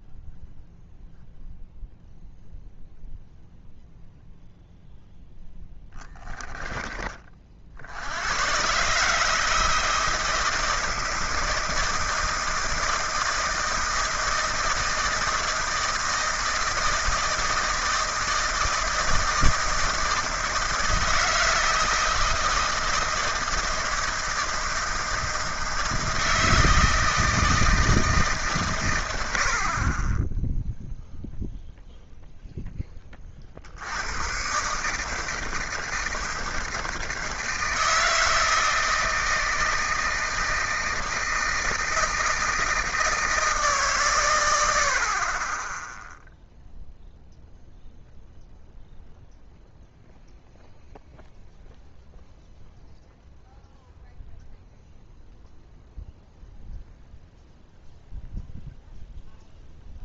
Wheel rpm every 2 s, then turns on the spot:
0, 0, 0, 10, 110, 160, 160, 160, 160, 160, 160, 160, 160, 160, 140, 10, 0, 130, 160, 160, 160, 160, 80, 0, 0, 0, 0, 0, 0, 0.
6-8